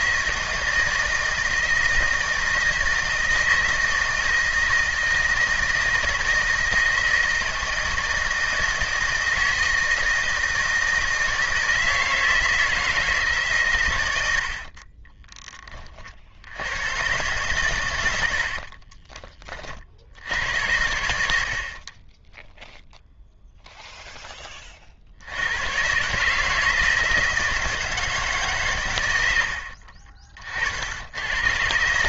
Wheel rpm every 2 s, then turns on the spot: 160, 160, 160, 160, 160, 160, 160, 40, 90, 50, 80, 0, 30, 160, 130, 50.
14-16 18-20